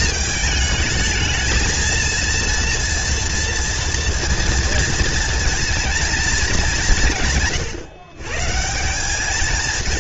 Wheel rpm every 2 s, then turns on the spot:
220, 230, 230, 200, 160.
none